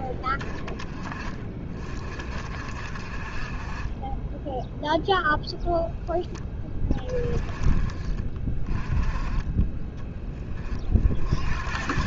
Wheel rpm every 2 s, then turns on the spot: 20, 50, 0, 20, 20, 30.
none